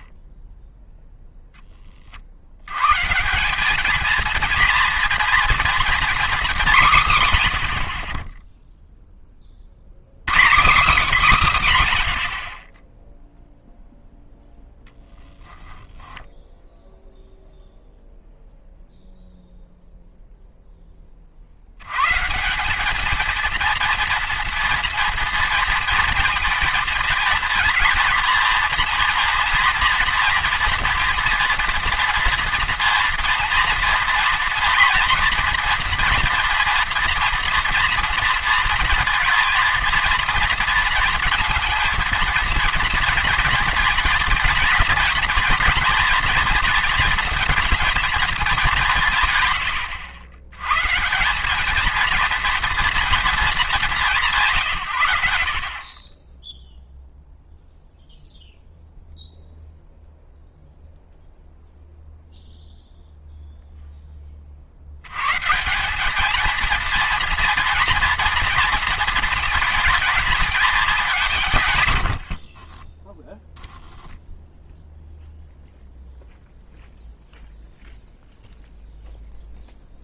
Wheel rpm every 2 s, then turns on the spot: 0, 160, 230, 150, 10, 220, 0, 0, 0, 0, 20, 220, 230, 220, 230, 230, 230, 230, 230, 230, 230, 230, 230, 230, 160, 140, 230, 110, 0, 0, 0, 0, 30, 220, 230, 210, 50, 0, 0, 0.
72-74